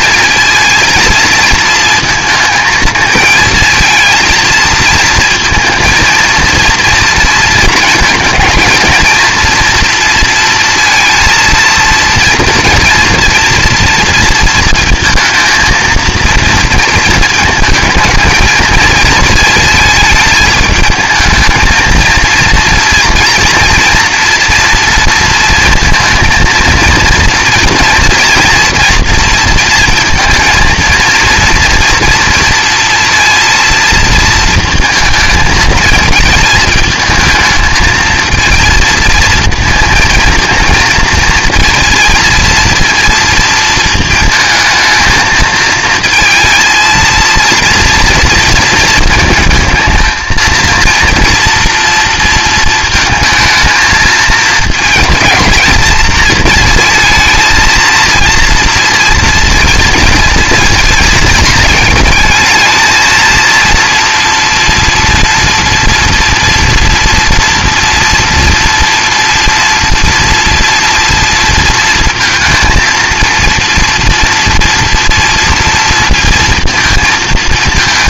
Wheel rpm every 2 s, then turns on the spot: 230, 230, 230, 230, 220, 230, 240, 220, 230, 220, 220, 230, 230, 230, 230, 230, 230, 220, 220, 230, 220, 230, 220, 230, 230, 230, 220, 220, 230, 230, 230, 220, 230, 230, 240, 230, 230, 230, 230.
none